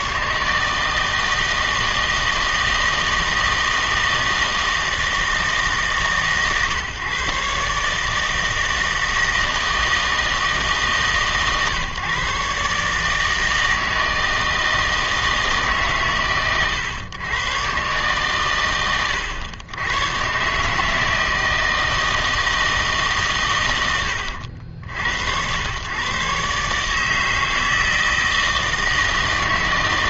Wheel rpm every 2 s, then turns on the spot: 150, 160, 160, 140, 160, 150, 150, 160, 120, 120, 140, 160, 70, 150, 160.
none